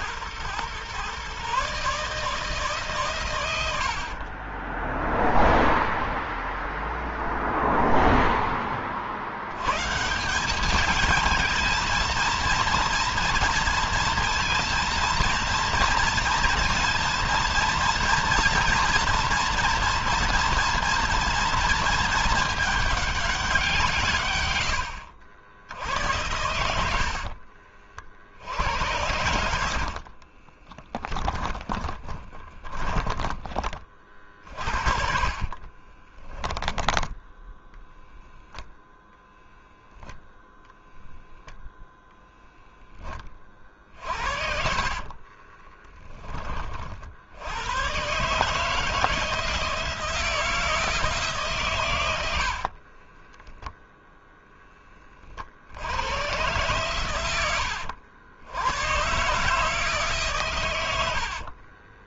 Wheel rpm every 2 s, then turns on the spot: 120, 130, 10, 0, 50, 220, 230, 230, 230, 240, 230, 200, 80, 70, 90, 10, 20, 50, 10, 10, 0, 20, 40, 50, 160, 160, 30, 20, 110, 110, 90.
4-6 26-32 34-36 44-46 52-54